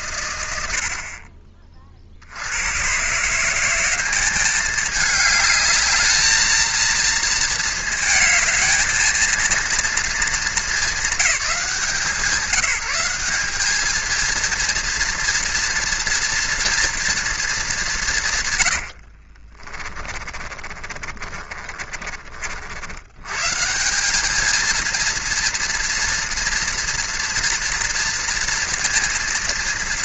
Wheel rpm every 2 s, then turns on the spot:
50, 110, 210, 220, 220, 220, 180, 230, 230, 80, 30, 80, 220, 230, 230.
18-22